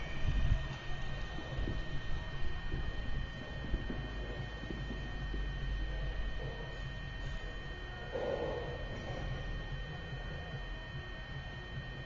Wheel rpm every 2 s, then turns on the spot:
0, 0, 0, 0, 0, 0.
none